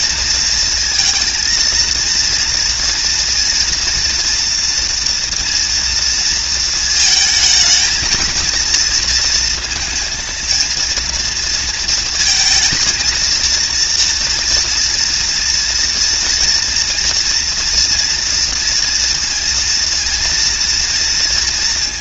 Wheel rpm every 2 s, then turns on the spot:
230, 230, 240, 230, 220, 230, 230, 230, 230, 230, 230.
none